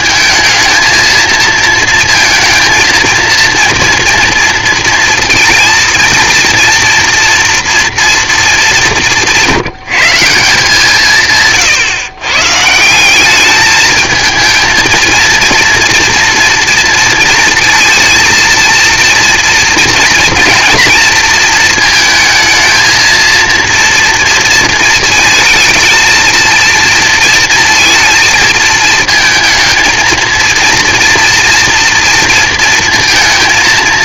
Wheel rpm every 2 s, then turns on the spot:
220, 230, 230, 230, 200, 160, 150, 220, 230, 230, 240, 220, 230, 230, 220, 230, 230.
none